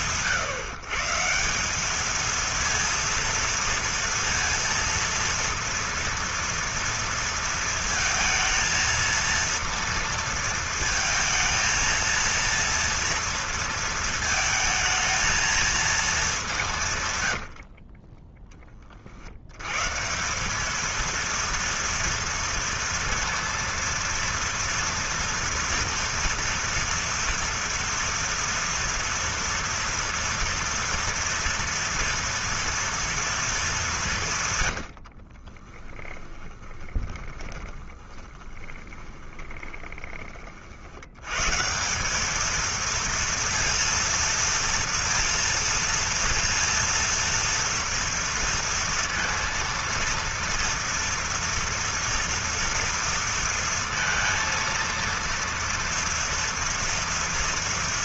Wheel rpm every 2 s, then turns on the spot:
150, 230, 230, 230, 230, 230, 230, 220, 160, 30, 220, 230, 230, 230, 230, 230, 230, 90, 20, 20, 60, 220, 230, 230, 230, 230, 230, 230, 230.
34-40